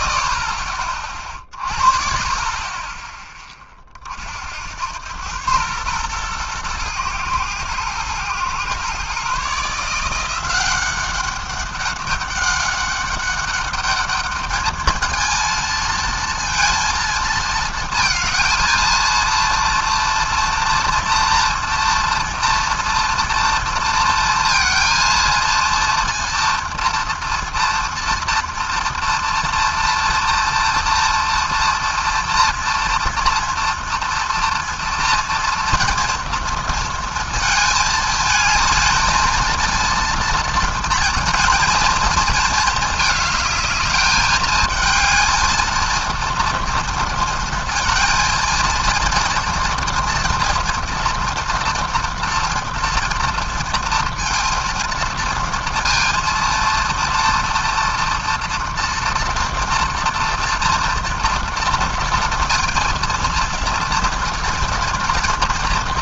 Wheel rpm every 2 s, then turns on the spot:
50, 20, 80, 110, 120, 180, 200, 220, 230, 220, 230, 230, 230, 230, 230, 230, 230, 230, 230, 220, 230, 220, 220, 230, 230, 230, 230, 230, 230, 230, 230, 230, 230.
none